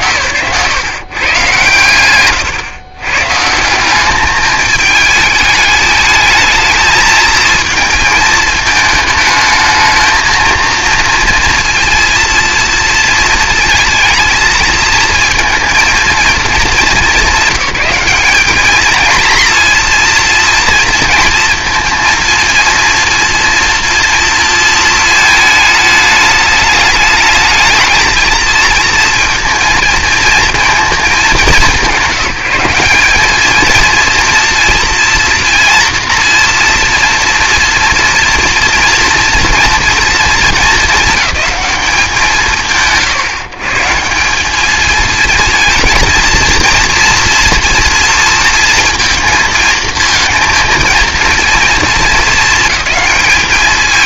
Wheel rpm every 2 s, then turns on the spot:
150, 130, 210, 220, 220, 230, 230, 230, 220, 210, 230, 230, 230, 220, 230, 230, 180, 230, 230, 230, 220, 110, 220, 230, 230, 230, 220.
none